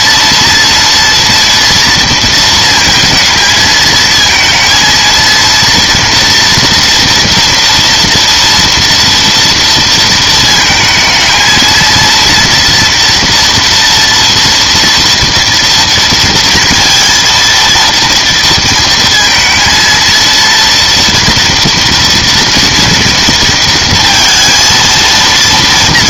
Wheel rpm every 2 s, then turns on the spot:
230, 230, 230, 230, 230, 220, 230, 230, 230, 230, 230, 230, 230.
none